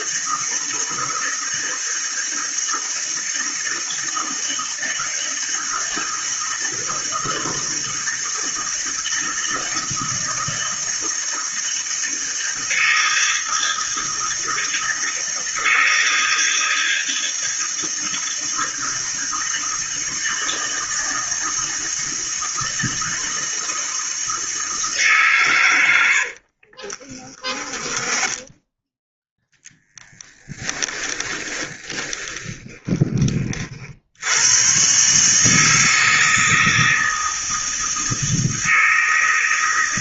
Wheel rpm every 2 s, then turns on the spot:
160, 160, 160, 160, 160, 160, 160, 160, 160, 160, 160, 160, 160, 40, 20, 20, 20, 110, 160, 160.
26-34